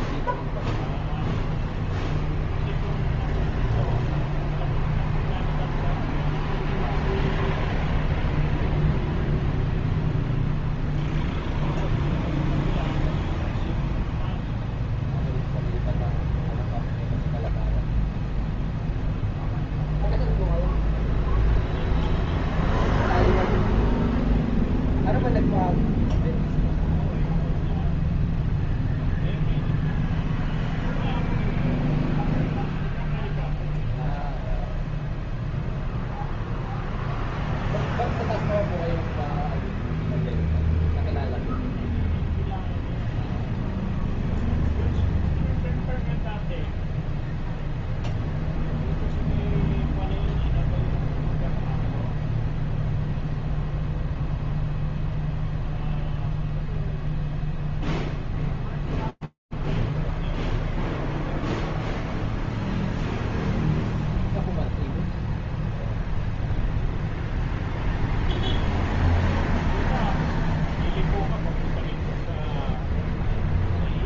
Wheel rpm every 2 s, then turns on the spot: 0, 0, 0, 0, 0, 0, 0, 0, 0, 0, 0, 0, 0, 0, 0, 0, 0, 0, 0, 0, 0, 0, 0, 0, 0, 0, 0, 0, 0, 0, 0, 0, 0, 0, 0, 0, 0.
none